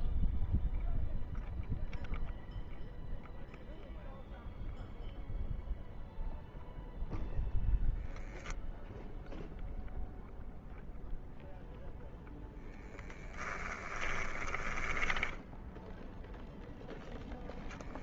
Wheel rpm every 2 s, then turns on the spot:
0, 0, 0, 0, 0, 0, 10, 0, 0.
12-14